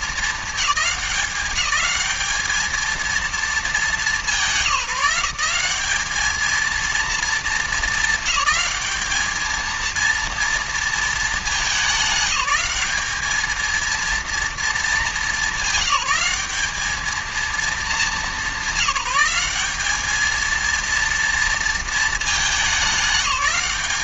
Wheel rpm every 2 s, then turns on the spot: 210, 220, 180, 230, 220, 220, 210, 210, 220, 200, 230, 190.
none